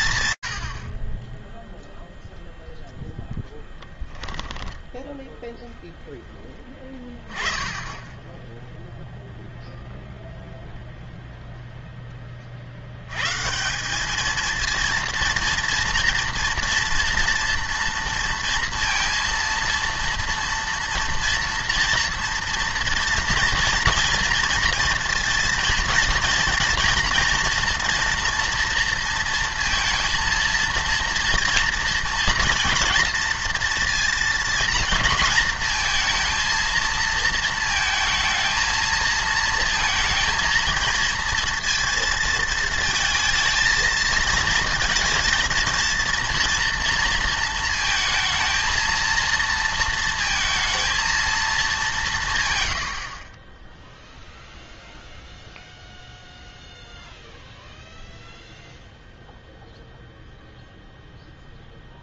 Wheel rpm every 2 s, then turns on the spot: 30, 10, 10, 10, 0, 0, 170, 230, 230, 230, 230, 230, 230, 230, 230, 230, 230, 230, 220, 230, 230, 230, 230, 230, 230, 220, 30, 0, 0, 0, 0.
4-6